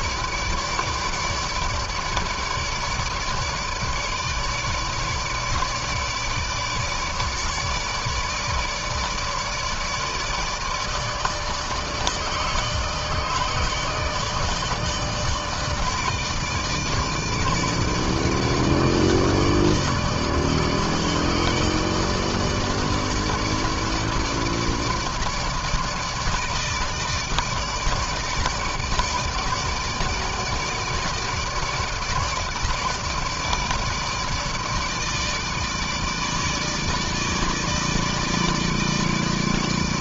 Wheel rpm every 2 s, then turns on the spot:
150, 150, 150, 150, 160, 150, 150, 150, 150, 150, 150, 160, 160, 150, 150, 160, 160, 160, 150, 160.
none